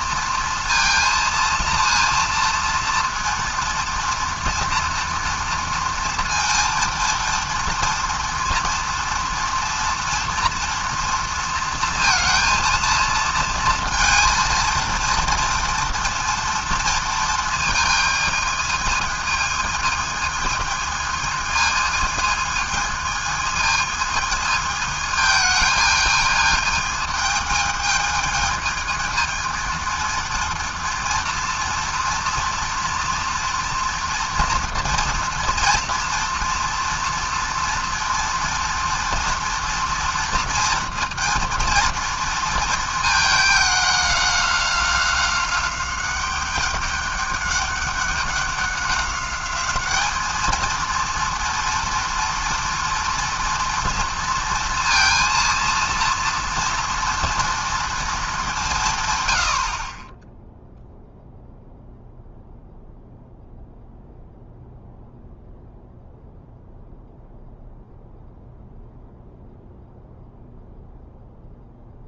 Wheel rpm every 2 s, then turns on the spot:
230, 230, 240, 230, 230, 230, 230, 230, 230, 220, 220, 220, 220, 220, 220, 230, 240, 230, 240, 240, 230, 220, 190, 200, 200, 230, 240, 230, 240, 170, 0, 0, 0, 0, 0, 0.
none